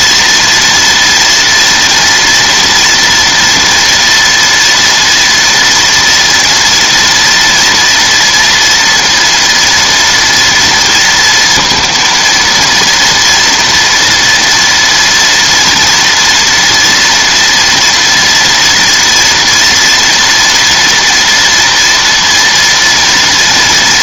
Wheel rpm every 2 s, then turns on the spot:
230, 230, 230, 240, 230, 230, 230, 230, 230, 230, 230, 230.
none